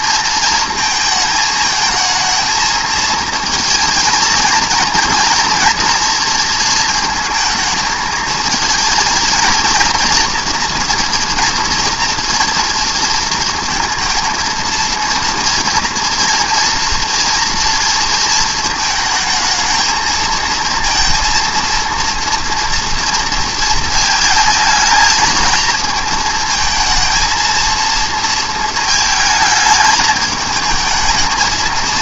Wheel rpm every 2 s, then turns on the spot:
220, 230, 230, 230, 230, 240, 230, 230, 230, 220, 230, 240, 220, 220, 220, 220.
none